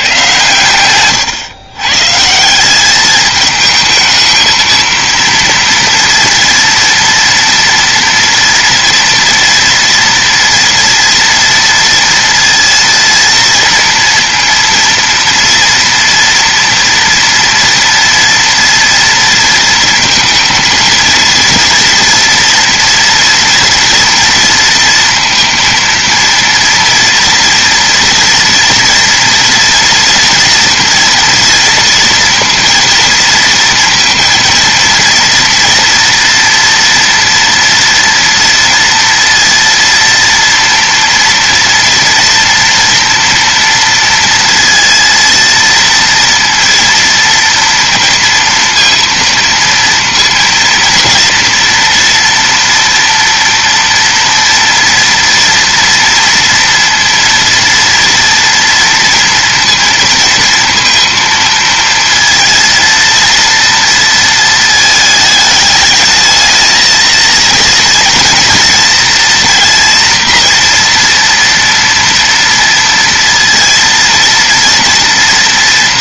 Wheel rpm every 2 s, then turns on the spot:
120, 180, 220, 230, 230, 240, 230, 230, 230, 230, 230, 230, 230, 230, 240, 230, 230, 230, 230, 230, 230, 240, 230, 230, 230, 230, 230, 240, 230, 230, 230, 230, 220, 230, 230, 240, 230, 230.
0-2